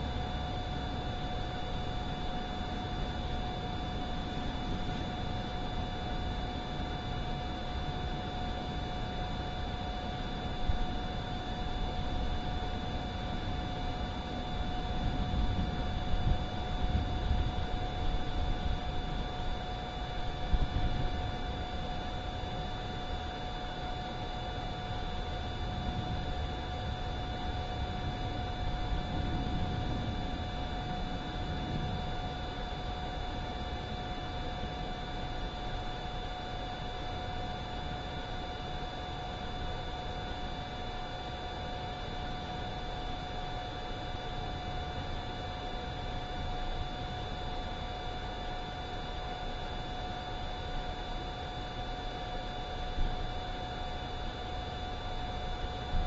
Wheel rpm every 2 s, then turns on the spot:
0, 0, 0, 0, 0, 0, 0, 0, 0, 0, 0, 0, 0, 0, 0, 0, 0, 0, 0, 0, 0, 0, 0, 0, 0, 0, 0, 0.
none